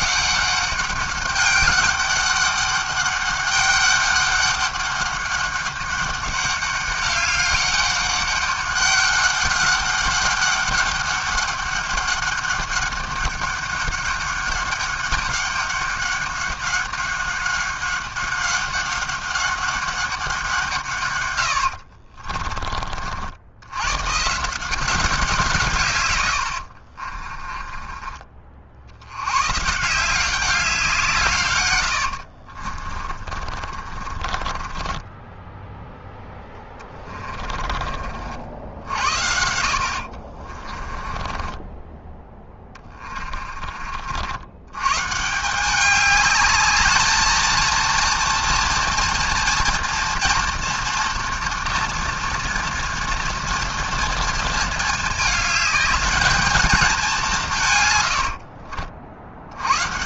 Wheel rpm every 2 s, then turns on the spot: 200, 200, 200, 200, 190, 200, 200, 200, 200, 200, 100, 60, 170, 30, 100, 140, 40, 10, 20, 70, 20, 30, 160, 220, 240, 230, 230, 220, 190, 70.
26-28 32-44